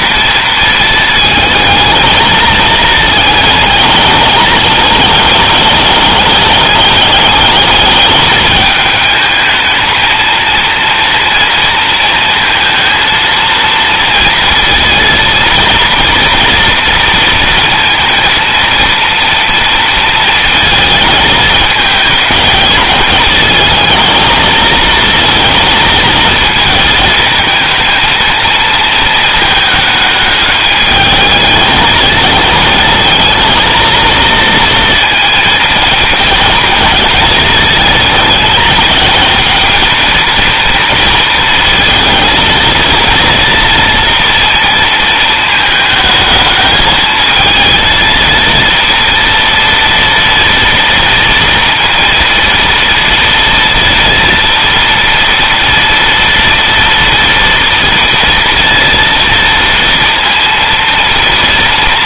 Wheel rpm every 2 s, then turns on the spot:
220, 220, 220, 210, 210, 230, 230, 230, 230, 230, 220, 210, 230, 220, 220, 210, 220, 230, 230, 220, 230, 230, 220, 220, 230, 230, 230, 230, 230, 230, 230.
none